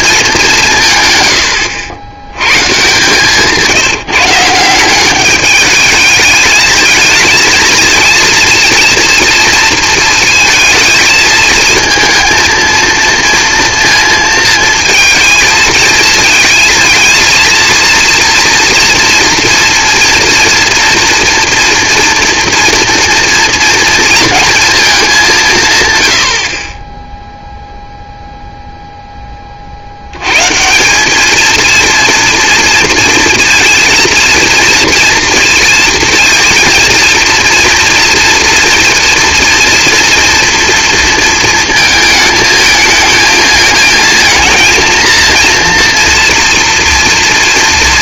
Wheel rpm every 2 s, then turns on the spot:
180, 130, 170, 220, 230, 230, 230, 220, 230, 230, 230, 230, 230, 50, 0, 140, 230, 230, 230, 240, 230, 220, 230, 230.
none